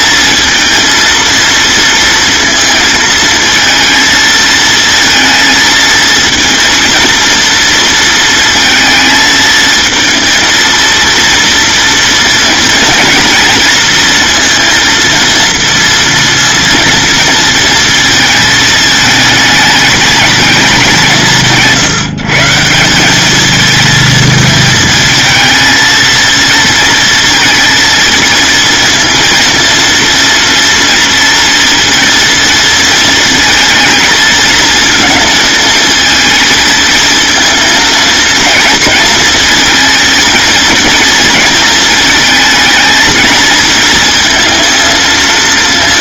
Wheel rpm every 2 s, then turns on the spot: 220, 220, 220, 230, 220, 230, 230, 230, 230, 220, 190, 180, 220, 230, 230, 230, 230, 230, 230, 230, 230, 230, 230.
none